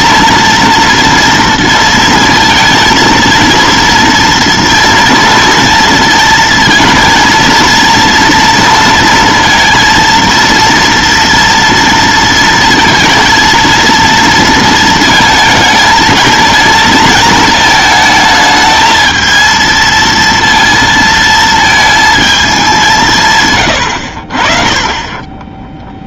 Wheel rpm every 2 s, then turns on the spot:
230, 230, 230, 230, 230, 230, 230, 230, 220, 220, 230, 200, 30.
none